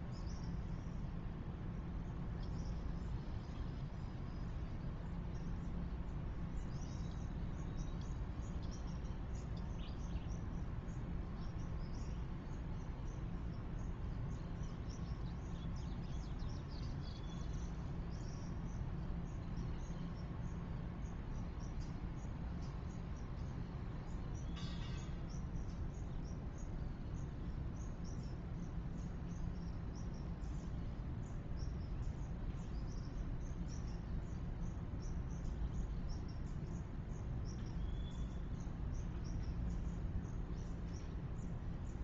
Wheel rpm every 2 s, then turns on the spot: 0, 0, 0, 0, 0, 0, 0, 0, 0, 0, 0, 0, 0, 0, 0, 0, 0, 0, 0, 0, 0.
none